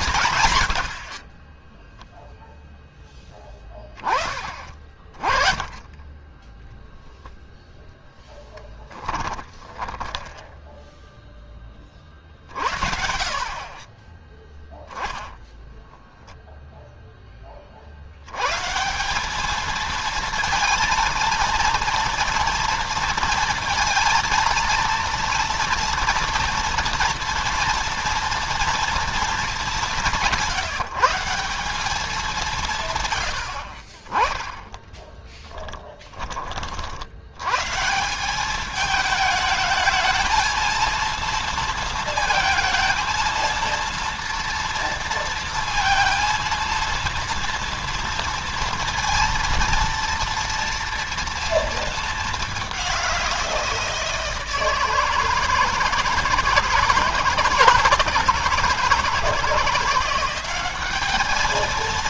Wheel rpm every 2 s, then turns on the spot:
110, 0, 30, 10, 20, 10, 60, 10, 0, 130, 230, 230, 230, 230, 230, 160, 180, 20, 30, 190, 220, 230, 230, 230, 230, 230, 210, 160, 160, 160, 190.
8-10